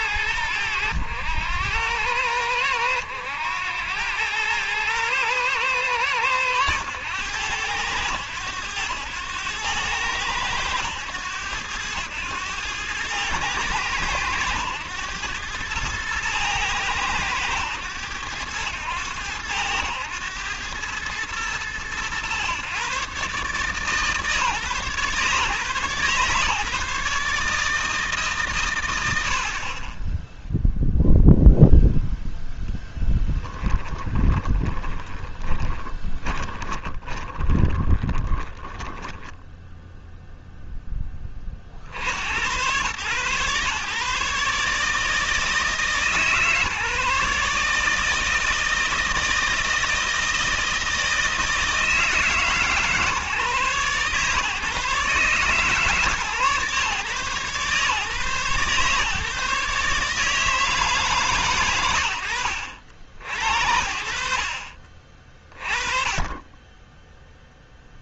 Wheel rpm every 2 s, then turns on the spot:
100, 100, 110, 110, 100, 100, 110, 100, 110, 90, 110, 120, 140, 130, 120, 0, 0, 10, 20, 10, 10, 100, 150, 150, 160, 160, 140, 140, 130, 140, 150, 80, 50, 10.
34-40